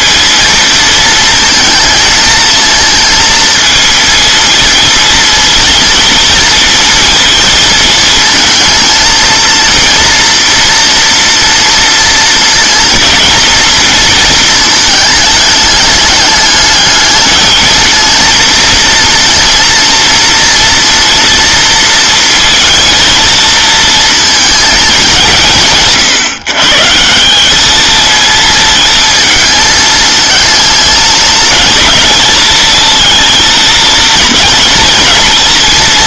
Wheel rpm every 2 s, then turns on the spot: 230, 230, 230, 230, 230, 240, 230, 220, 210, 230, 230, 230, 230, 150, 220, 220, 220, 230.
none